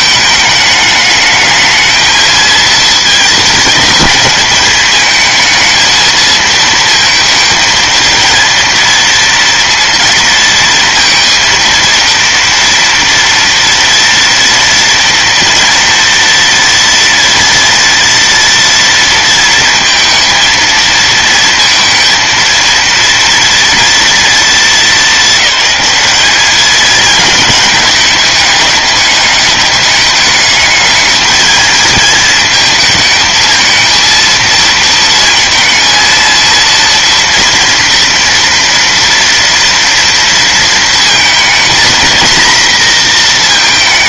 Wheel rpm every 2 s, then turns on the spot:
210, 220, 210, 230, 230, 230, 230, 230, 230, 230, 220, 230, 230, 210, 210, 210, 220, 230, 230, 230, 230, 240.
none